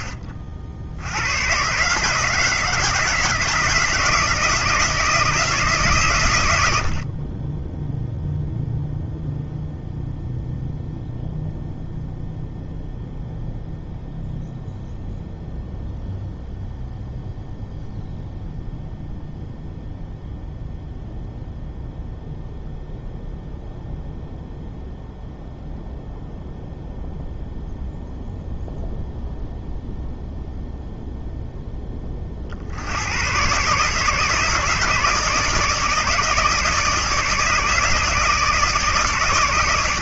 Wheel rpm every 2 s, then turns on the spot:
80, 160, 160, 50, 0, 0, 0, 0, 0, 0, 0, 0, 0, 0, 0, 0, 110, 160, 150, 110.
none